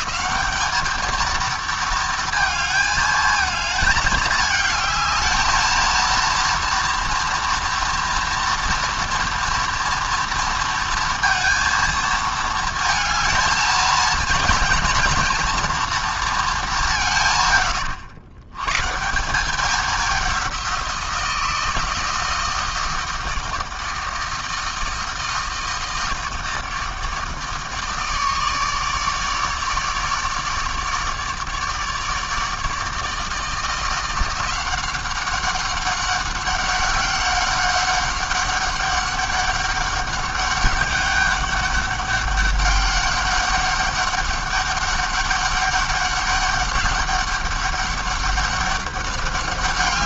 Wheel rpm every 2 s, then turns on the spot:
220, 220, 220, 230, 230, 230, 220, 230, 210, 130, 180, 160, 160, 160, 150, 150, 160, 180, 190, 200, 200, 200, 200, 200, 200.
none